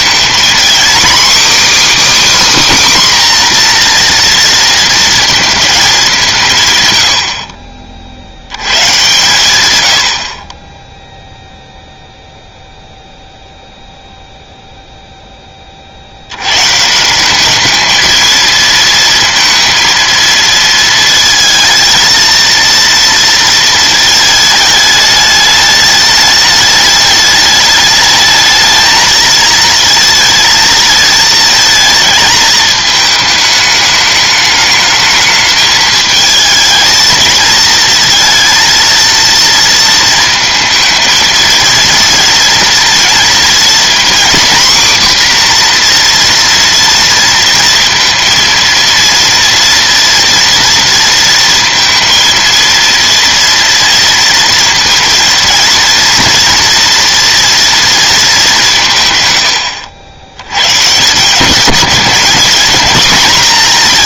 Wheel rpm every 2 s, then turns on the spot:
250, 280, 230, 140, 120, 10, 0, 0, 150, 230, 230, 230, 220, 210, 220, 220, 220, 220, 220, 230, 220, 230, 250, 230, 230, 230, 230, 230, 230, 160, 120, 220.
none